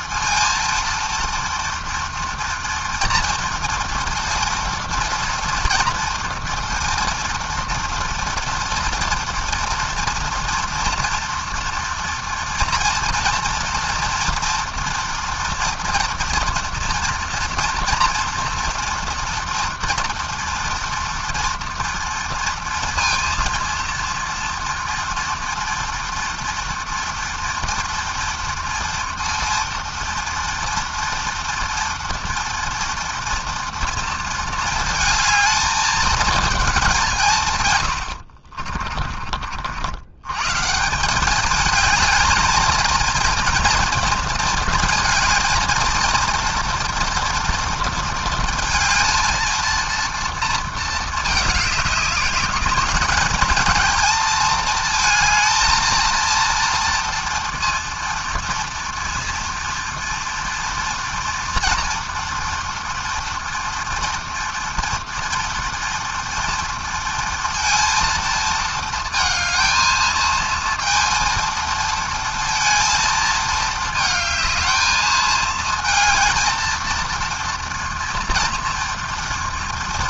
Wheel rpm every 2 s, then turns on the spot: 230, 230, 230, 230, 230, 230, 230, 230, 240, 230, 230, 230, 230, 230, 230, 230, 230, 220, 160, 40, 200, 230, 230, 230, 230, 220, 210, 230, 230, 230, 230, 230, 240, 230, 220, 230, 220, 220, 230, 230.
none